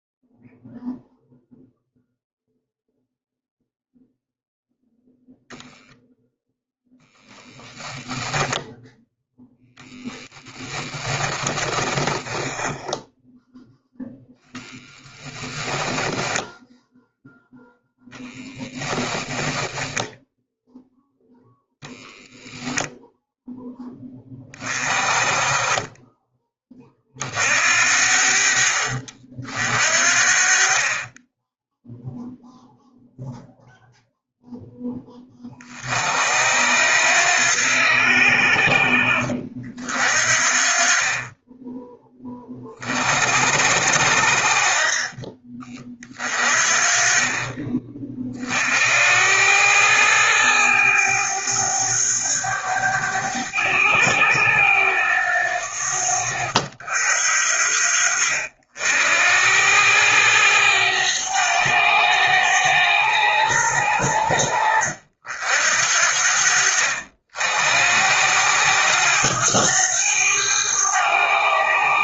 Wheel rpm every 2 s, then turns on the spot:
0, 0, 0, 0, 0, 10, 10, 10, 0, 10, 0, 0, 20, 40, 60, 20, 0, 20, 80, 50, 20, 50, 40, 30, 70, 100, 100, 90, 60, 80, 100, 90, 70, 70, 90, 90.
14-16 18-20